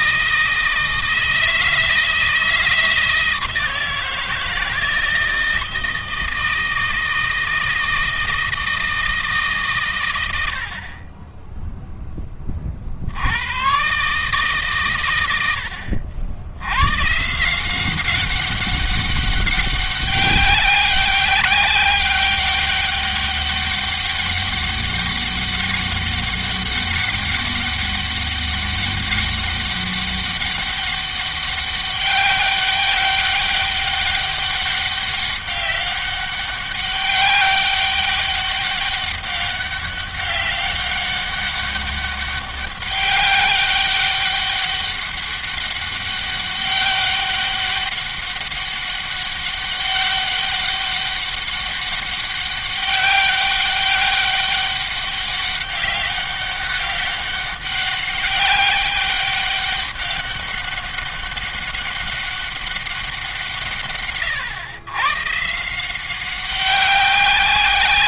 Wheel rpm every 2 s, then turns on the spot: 160, 160, 160, 160, 160, 40, 60, 120, 130, 200, 200, 200, 200, 200, 200, 190, 200, 200, 200, 200, 200, 190, 200, 200, 200, 200, 200, 200, 200, 200, 200, 190, 120, 190.
none